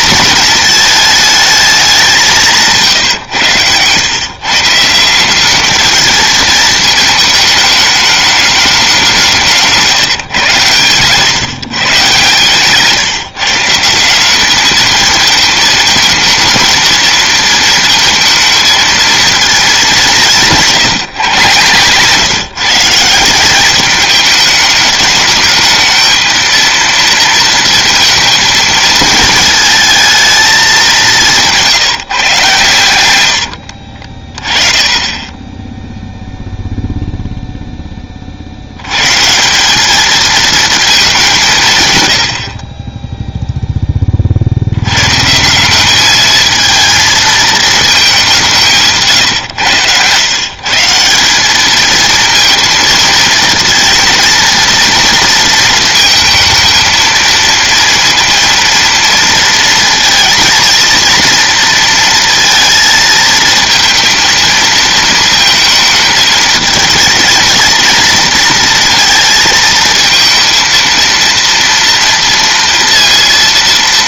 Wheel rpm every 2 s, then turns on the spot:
220, 160, 150, 220, 210, 120, 140, 200, 230, 220, 170, 160, 220, 230, 220, 220, 130, 20, 0, 70, 220, 60, 60, 220, 180, 140, 230, 230, 220, 230, 230, 230, 230, 220, 230, 230, 230.
none